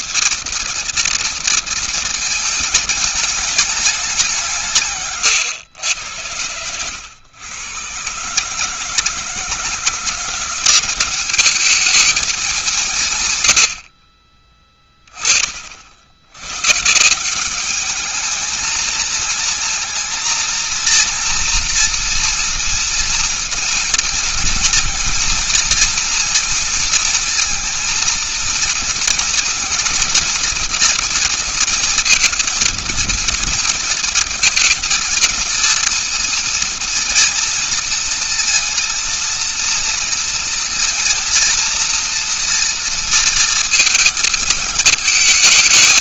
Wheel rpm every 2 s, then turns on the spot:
230, 220, 170, 100, 150, 180, 200, 30, 110, 220, 230, 230, 230, 230, 230, 240, 230, 230, 230, 230, 230, 230, 220.
none